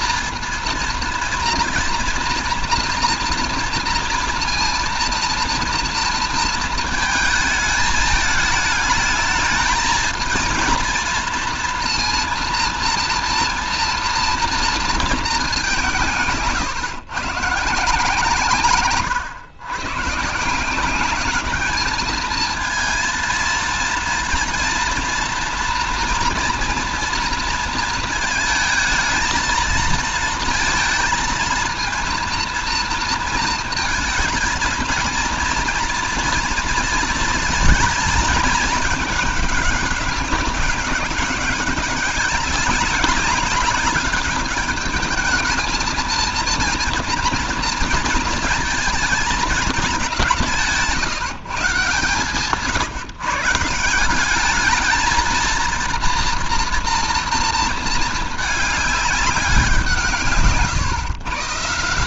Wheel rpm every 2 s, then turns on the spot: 230, 230, 230, 230, 210, 230, 240, 230, 140, 140, 160, 220, 230, 230, 220, 230, 230, 230, 230, 220, 200, 200, 200, 230, 230, 180, 130, 200, 240, 210, 150.
none